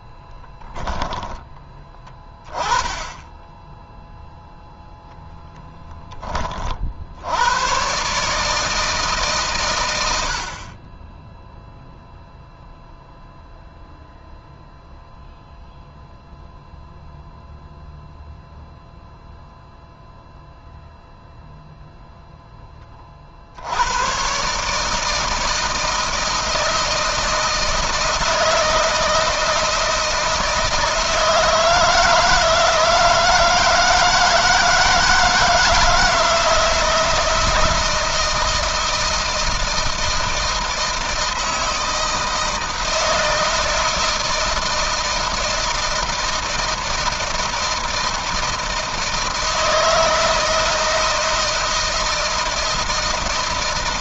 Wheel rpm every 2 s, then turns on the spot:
10, 20, 0, 20, 150, 60, 0, 0, 0, 0, 0, 0, 130, 160, 160, 160, 160, 160, 160, 160, 160, 160, 160, 160, 160, 160, 160.
0-2